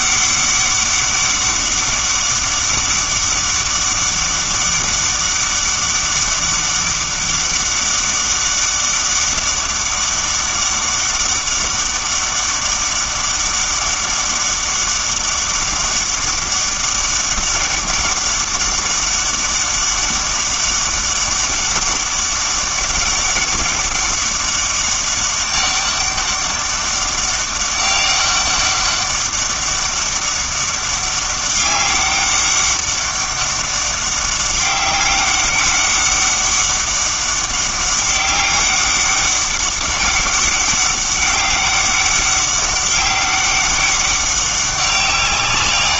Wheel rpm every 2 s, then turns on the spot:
200, 200, 200, 200, 200, 200, 200, 200, 200, 200, 200, 200, 200, 200, 200, 200, 200, 190, 200, 200, 200, 190, 190.
none